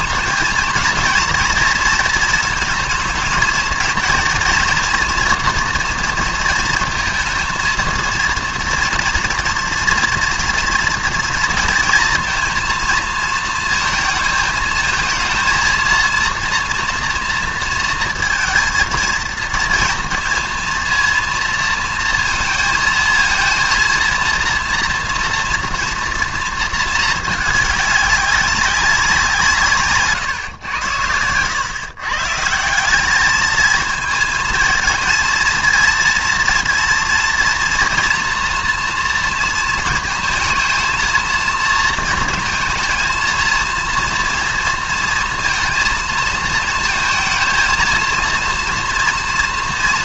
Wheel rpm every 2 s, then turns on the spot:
230, 230, 230, 230, 230, 230, 230, 220, 230, 230, 230, 230, 230, 230, 200, 120, 150, 220, 230, 240, 220, 230, 230, 220, 230.
none